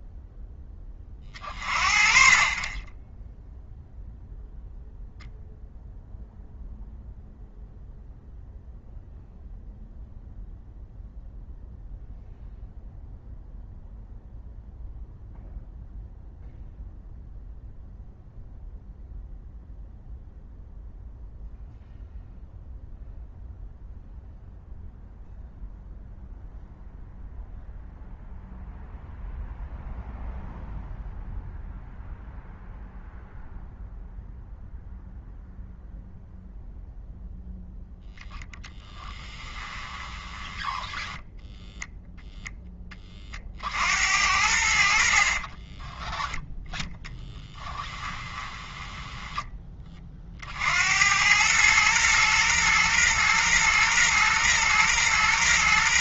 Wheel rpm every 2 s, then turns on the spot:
20, 20, 0, 0, 0, 0, 0, 0, 0, 0, 0, 0, 0, 0, 0, 0, 0, 0, 0, 10, 10, 20, 70, 10, 10, 90, 120, 120.
38-42 44-46 48-50